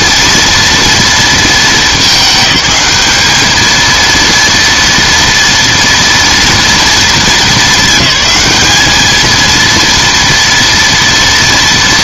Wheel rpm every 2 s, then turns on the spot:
230, 210, 230, 230, 210, 230.
none